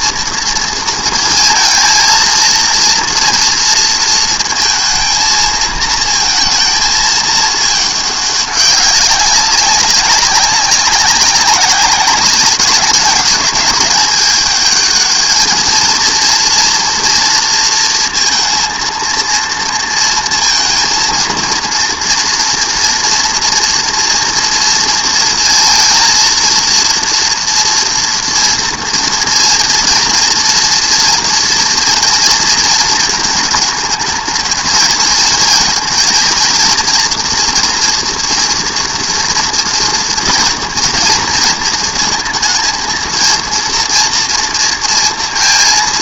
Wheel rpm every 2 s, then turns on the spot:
230, 230, 220, 220, 190, 190, 190, 210, 230, 230, 230, 230, 230, 230, 230, 230, 230, 220, 230, 230, 230, 220, 230.
none